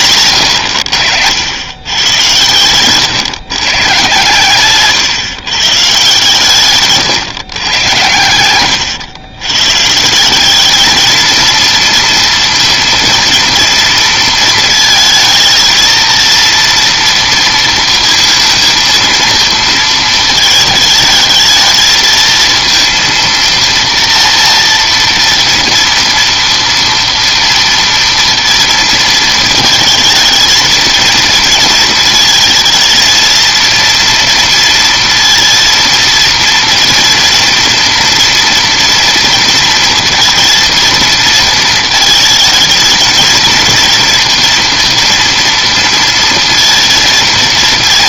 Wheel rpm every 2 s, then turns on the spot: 120, 120, 120, 140, 110, 200, 230, 220, 230, 230, 220, 230, 230, 230, 230, 220, 220, 230, 230, 230, 230, 220, 230, 230.
8-10